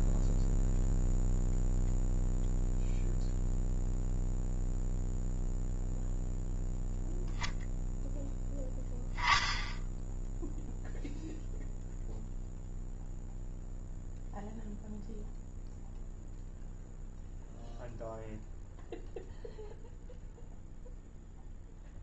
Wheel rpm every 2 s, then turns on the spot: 0, 0, 0, 0, 0, 0, 0, 0, 0, 0, 0.
none